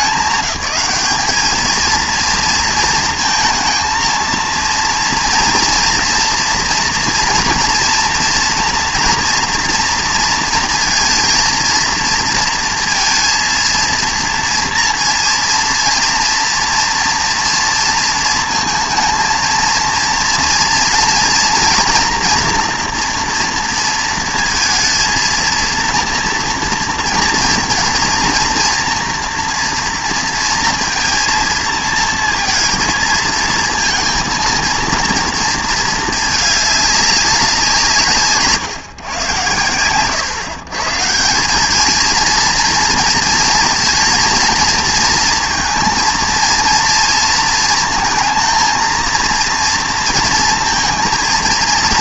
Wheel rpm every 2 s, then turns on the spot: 210, 230, 230, 240, 240, 230, 230, 230, 230, 230, 240, 240, 230, 230, 230, 230, 230, 230, 210, 140, 140, 230, 230, 230, 220, 230.
none